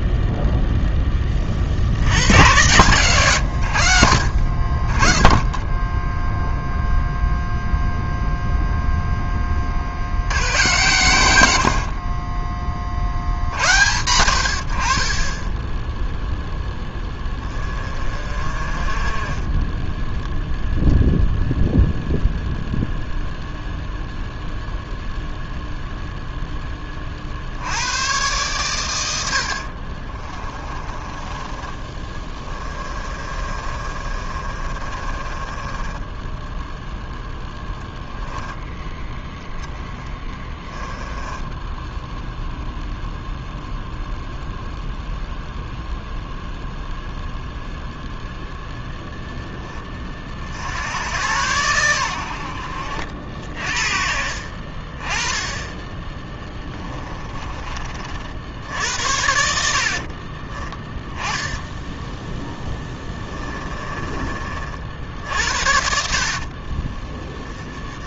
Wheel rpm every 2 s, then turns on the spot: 0, 120, 40, 0, 0, 110, 30, 70, 10, 30, 0, 0, 0, 10, 110, 30, 20, 40, 10, 10, 10, 0, 0, 0, 0, 80, 70, 50, 20, 70, 20, 10, 50, 30.
30-38 40-42 56-58 60-64